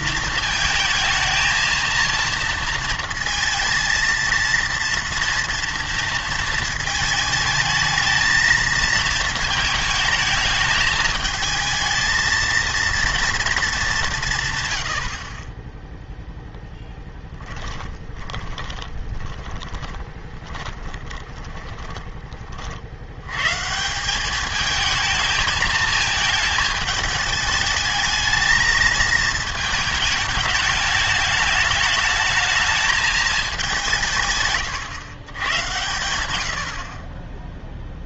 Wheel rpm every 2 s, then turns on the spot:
220, 230, 230, 230, 220, 210, 230, 120, 10, 20, 20, 50, 210, 220, 220, 210, 220, 130, 60.
18-22